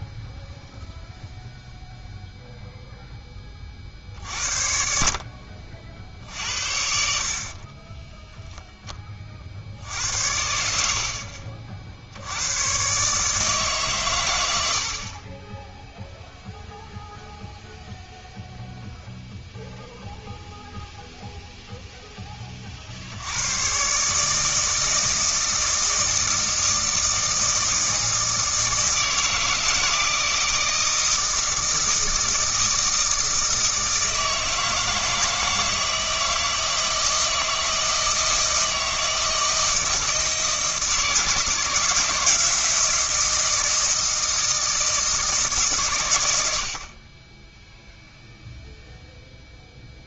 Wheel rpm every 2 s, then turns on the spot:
0, 0, 60, 60, 10, 70, 120, 80, 0, 0, 0, 40, 160, 160, 160, 160, 160, 160, 160, 160, 160, 170, 160, 60, 0.
none